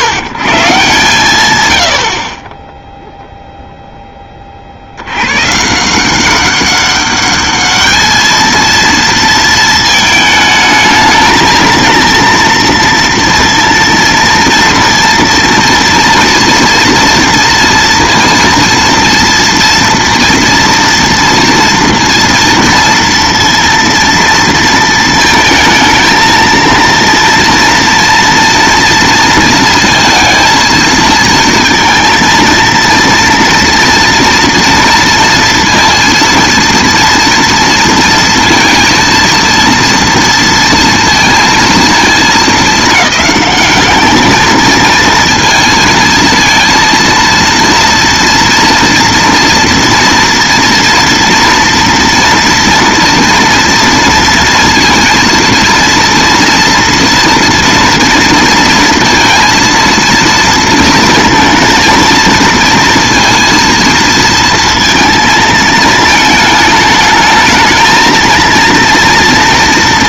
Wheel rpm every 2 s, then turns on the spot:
120, 40, 30, 190, 220, 220, 230, 230, 230, 230, 230, 230, 230, 230, 230, 230, 230, 230, 230, 230, 230, 220, 220, 230, 230, 230, 240, 230, 230, 230, 230, 230, 230, 220, 230.
none